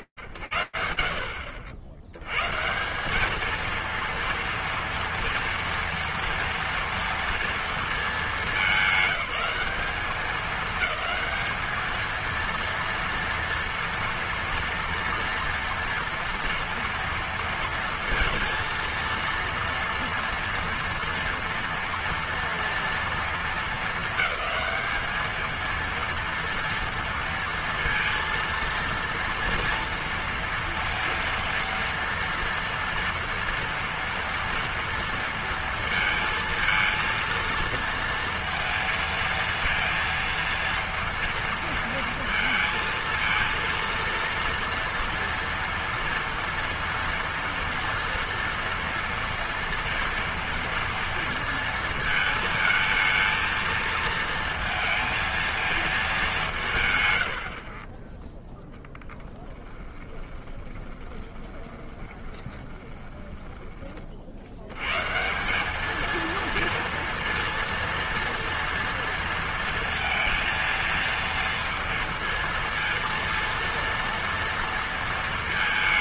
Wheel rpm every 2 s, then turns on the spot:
70, 140, 230, 230, 190, 210, 230, 230, 230, 230, 230, 230, 220, 230, 230, 230, 230, 230, 230, 230, 230, 230, 230, 230, 230, 230, 220, 230, 80, 10, 20, 20, 160, 230, 230, 230, 230, 220.
56-64